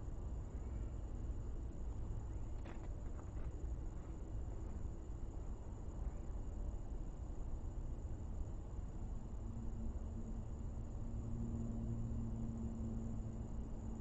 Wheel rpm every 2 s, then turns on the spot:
0, 0, 0, 0, 0, 0, 0.
none